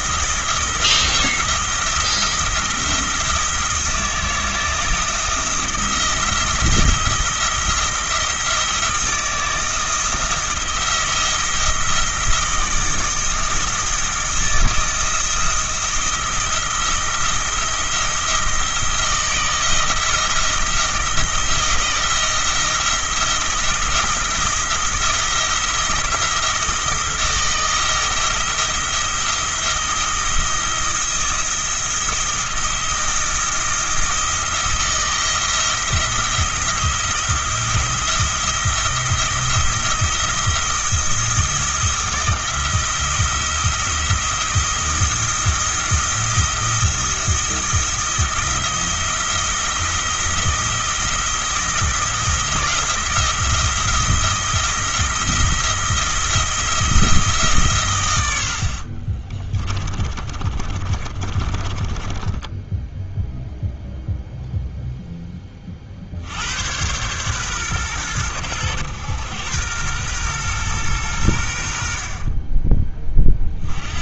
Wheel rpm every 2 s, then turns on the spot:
170, 170, 160, 170, 170, 170, 170, 160, 170, 160, 170, 170, 170, 170, 170, 160, 170, 170, 170, 170, 170, 170, 170, 170, 170, 170, 170, 170, 160, 50, 30, 10, 0, 100, 100, 120, 20.
58-64